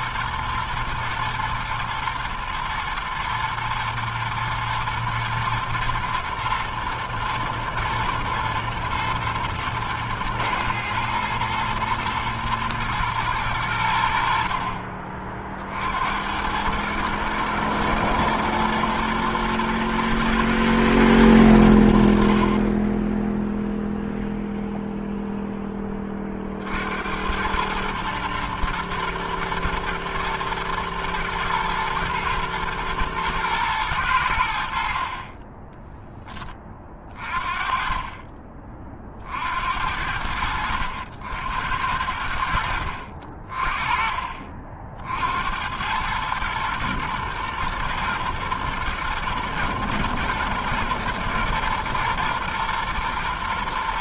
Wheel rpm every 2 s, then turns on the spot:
120, 110, 110, 110, 110, 110, 110, 50, 90, 120, 120, 60, 0, 40, 110, 110, 120, 90, 10, 30, 80, 80, 40, 110, 120, 120, 120.
none